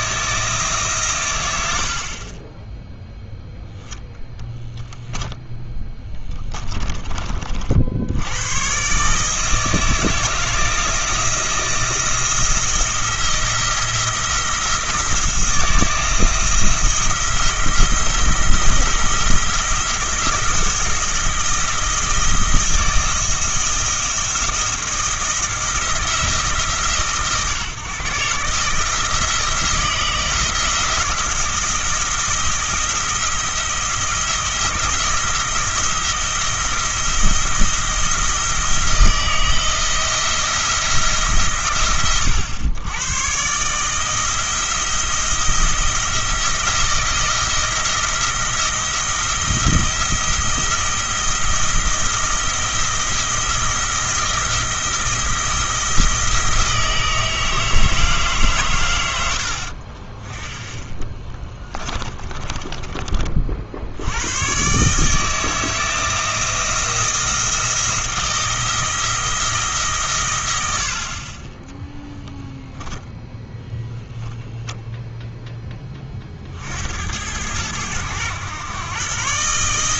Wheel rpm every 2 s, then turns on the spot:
160, 10, 0, 20, 120, 160, 170, 170, 170, 170, 170, 170, 170, 150, 150, 160, 170, 170, 170, 170, 170, 100, 170, 170, 170, 170, 170, 170, 160, 120, 20, 20, 130, 170, 160, 80, 10, 0, 70, 120.
6-8 62-64